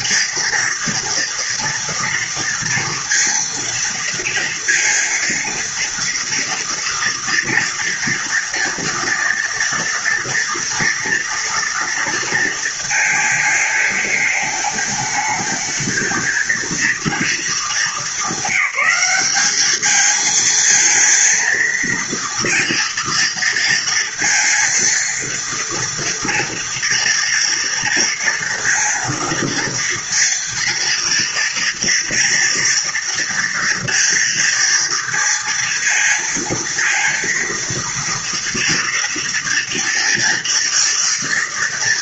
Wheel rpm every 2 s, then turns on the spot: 230, 230, 230, 240, 240, 230, 230, 220, 230, 210, 220, 230, 230, 230, 230, 230, 230, 230, 230, 230, 230.
none